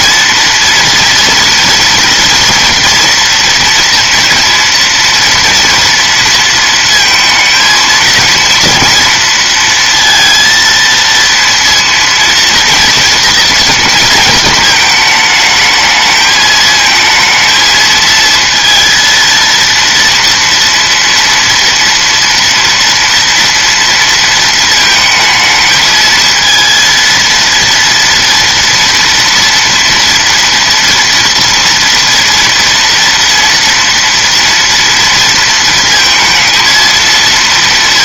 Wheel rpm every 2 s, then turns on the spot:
230, 230, 230, 230, 230, 230, 230, 220, 220, 230, 230, 230, 230, 230, 230, 230, 230, 230, 230.
none